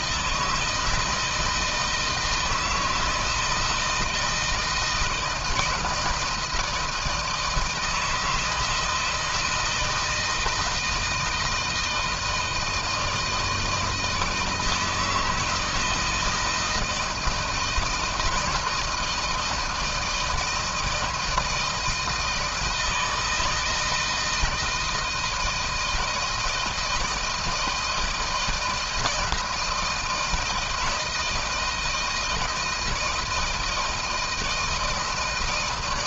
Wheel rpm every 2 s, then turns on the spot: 160, 160, 160, 160, 160, 160, 160, 160, 160, 160, 160, 160, 160, 160, 170, 160, 160, 160.
none